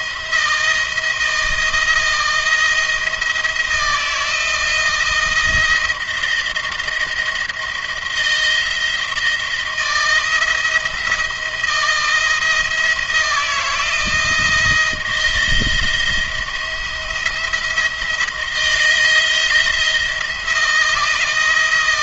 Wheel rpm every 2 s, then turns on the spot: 170, 170, 160, 160, 170, 160, 170, 170, 170, 160, 170.
none